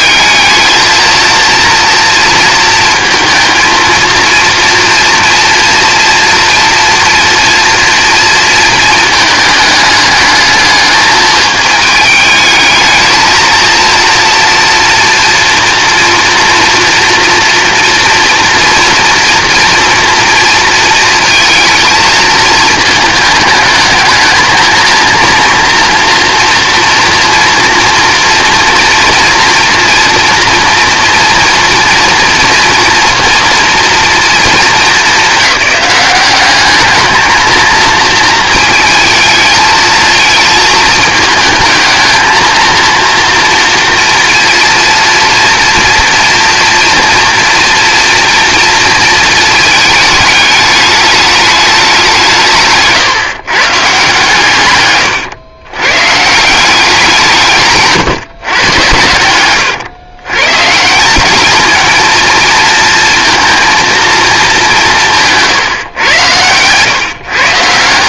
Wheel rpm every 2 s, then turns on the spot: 220, 230, 230, 230, 220, 210, 220, 230, 230, 230, 230, 220, 220, 230, 230, 240, 230, 210, 210, 220, 220, 230, 230, 230, 230, 210, 140, 120, 180, 110, 150, 230, 190, 110.
54-56